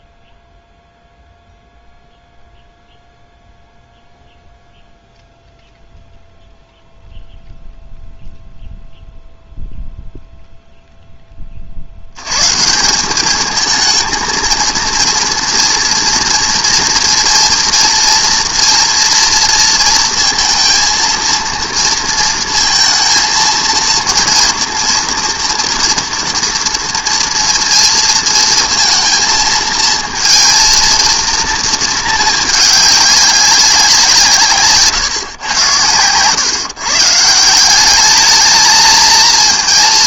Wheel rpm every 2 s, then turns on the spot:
0, 0, 0, 0, 0, 0, 160, 230, 230, 230, 230, 230, 240, 230, 230, 230, 210, 140, 140, 220.
none